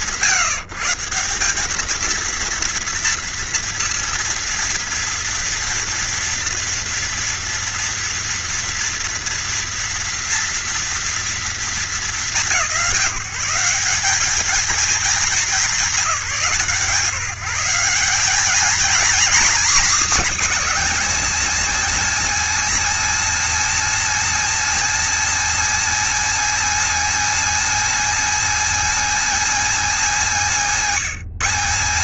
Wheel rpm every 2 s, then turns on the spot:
150, 230, 230, 230, 230, 230, 160, 210, 160, 230, 270, 280, 280, 280, 280, 170.
none